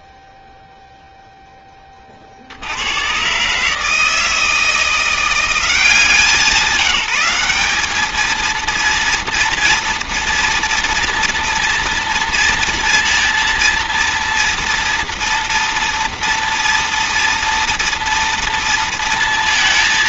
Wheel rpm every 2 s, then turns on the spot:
0, 70, 170, 190, 230, 230, 230, 230, 230, 230.
none